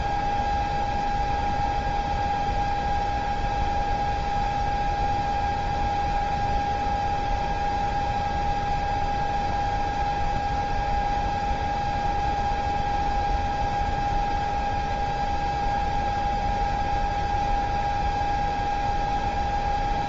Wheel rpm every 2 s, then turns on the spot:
0, 0, 0, 0, 0, 0, 0, 0, 0, 0.
none